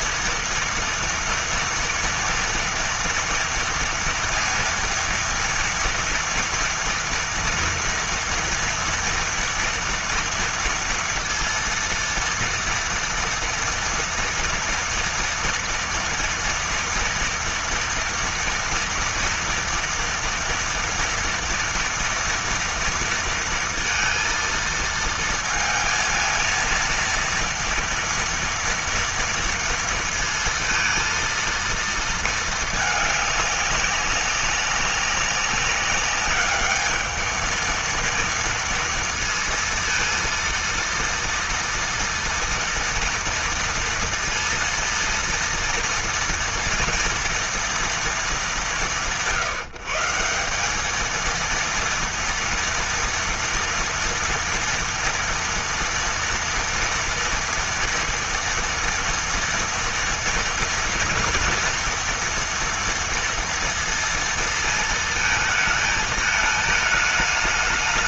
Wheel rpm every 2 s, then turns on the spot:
230, 230, 230, 230, 230, 230, 230, 230, 230, 230, 230, 230, 230, 230, 230, 230, 210, 200, 220, 230, 230, 230, 230, 230, 150, 210, 230, 240, 230, 230, 230, 230, 220, 220.
none